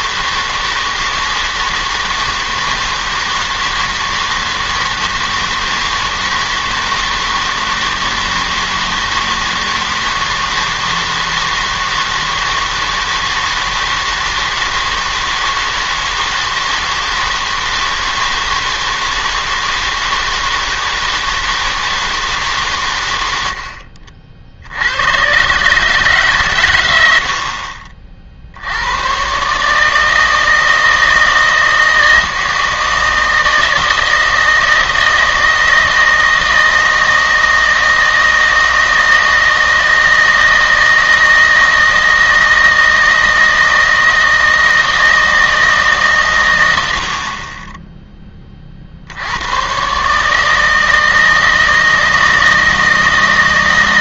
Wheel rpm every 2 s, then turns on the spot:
160, 160, 160, 160, 160, 160, 160, 160, 160, 160, 160, 140, 60, 120, 70, 160, 160, 160, 160, 160, 160, 160, 160, 100, 30, 160, 160.
none